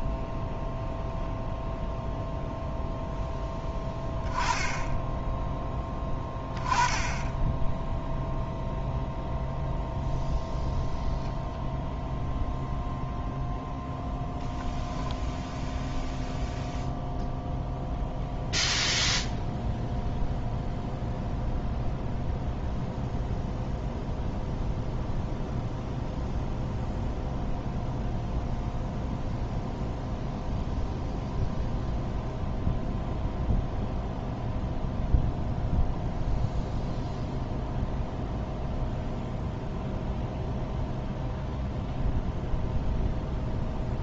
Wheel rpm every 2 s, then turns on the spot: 0, 0, 10, 20, 0, 0, 0, 10, 0, 0, 0, 0, 0, 0, 0, 0, 0, 0, 0, 0, 0, 0.
none